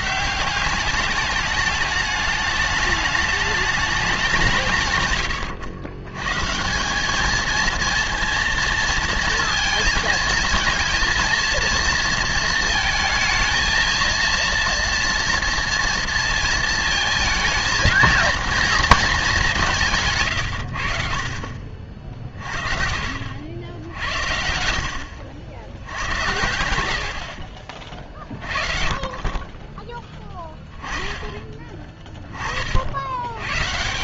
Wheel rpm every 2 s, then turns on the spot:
200, 210, 140, 160, 230, 230, 220, 230, 220, 230, 90, 40, 70, 80, 40, 10, 40.
26-28